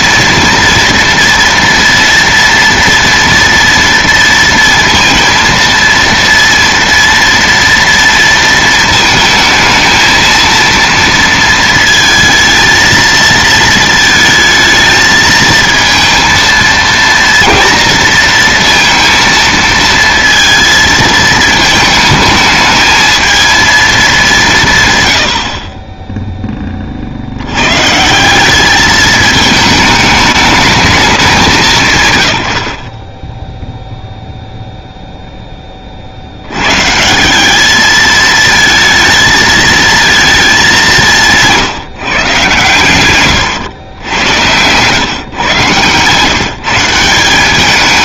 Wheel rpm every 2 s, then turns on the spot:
230, 230, 230, 230, 220, 230, 230, 220, 230, 230, 230, 220, 120, 60, 210, 200, 30, 0, 140, 220, 180, 120, 120, 160.
none